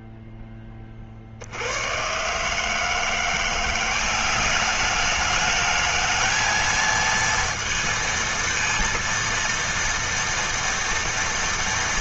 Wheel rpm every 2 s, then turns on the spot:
50, 170, 210, 230, 230, 230.
none